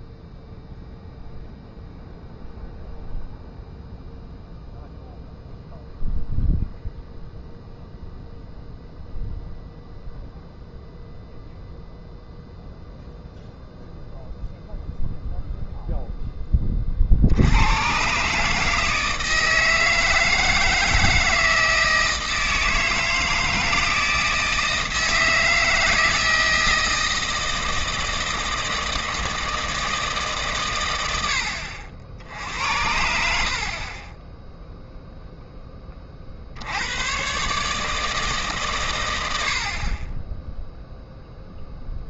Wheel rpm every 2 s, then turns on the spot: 0, 0, 0, 0, 0, 0, 0, 0, 30, 150, 160, 160, 160, 160, 160, 120, 80, 0, 80, 130, 0.
none